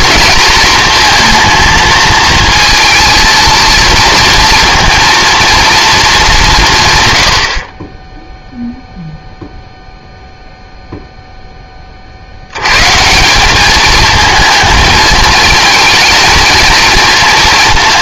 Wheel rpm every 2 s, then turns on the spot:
220, 230, 240, 170, 0, 0, 110, 220, 230.
none